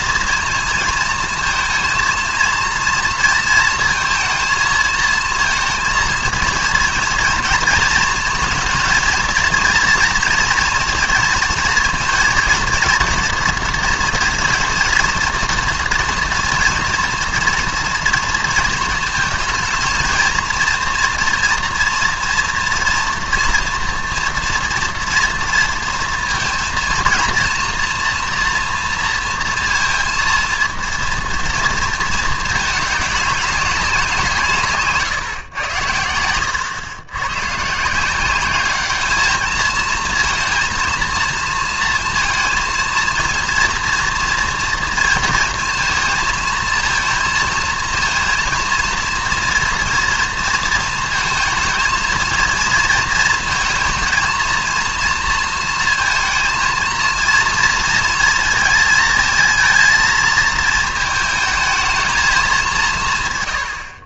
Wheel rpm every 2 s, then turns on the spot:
230, 230, 230, 230, 220, 230, 230, 230, 230, 230, 230, 230, 230, 230, 230, 230, 220, 180, 90, 180, 230, 230, 230, 230, 230, 230, 230, 230, 230, 230, 230, 220.
none